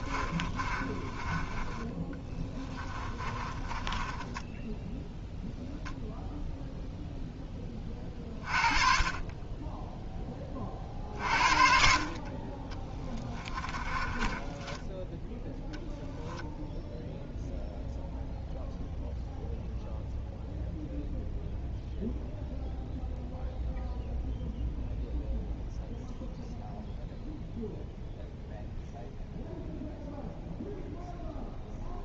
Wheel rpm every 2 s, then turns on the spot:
30, 20, 10, 0, 30, 20, 30, 20, 0, 0, 0, 0, 0, 0, 0, 0.
0-6 14-16